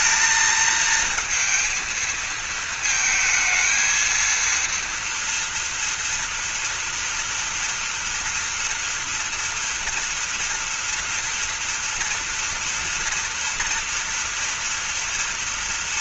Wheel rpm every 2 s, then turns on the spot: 220, 230, 230, 240, 230, 230, 230, 230.
none